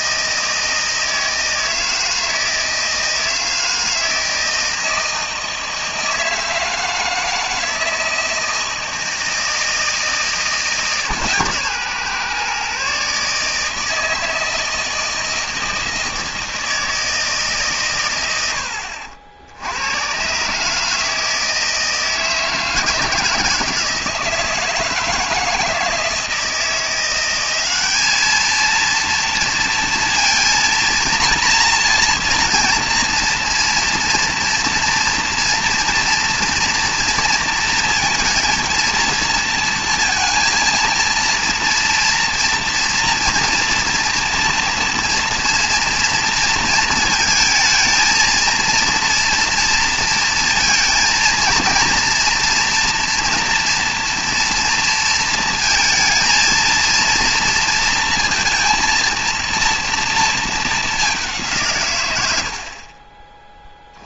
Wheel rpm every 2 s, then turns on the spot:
160, 160, 160, 160, 160, 160, 130, 160, 160, 80, 150, 160, 160, 170, 230, 230, 230, 230, 230, 230, 220, 230, 230, 230, 230, 230, 230, 230, 230, 230, 220, 60.
none